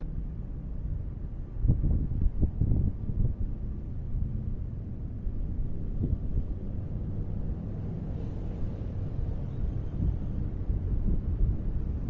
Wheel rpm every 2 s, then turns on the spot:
0, 0, 0, 0, 0, 0.
none